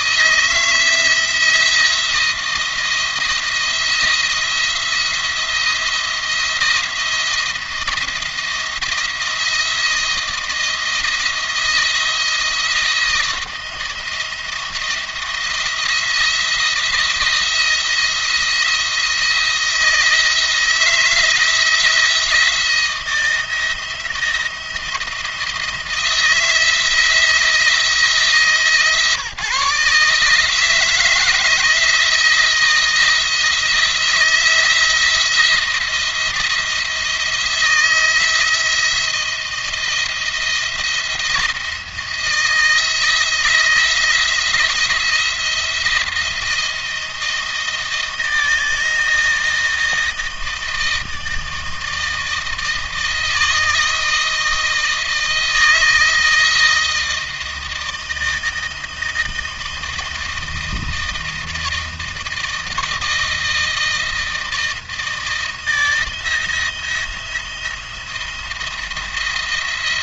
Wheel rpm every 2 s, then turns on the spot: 160, 170, 170, 170, 170, 160, 170, 170, 170, 170, 160, 170, 170, 160, 150, 160, 160, 170, 170, 170, 170, 160, 170, 170, 160, 160, 160, 160, 160, 160, 160, 160, 160, 160, 170.
none